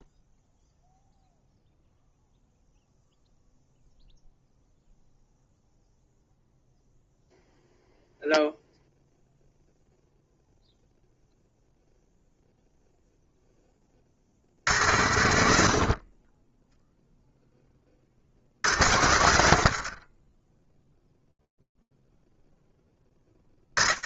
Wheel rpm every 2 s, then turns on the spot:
0, 0, 0, 0, 0, 0, 0, 60, 20, 50, 0, 10.
none